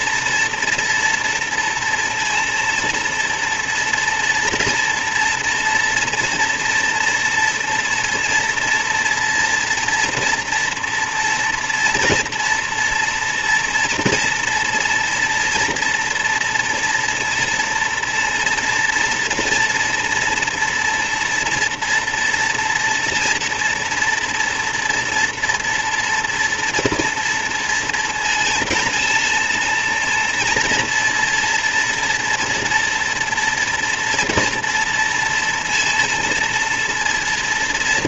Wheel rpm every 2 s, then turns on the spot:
230, 230, 230, 230, 230, 230, 230, 240, 230, 240, 230, 240, 230, 240, 230, 230, 230, 230, 230.
none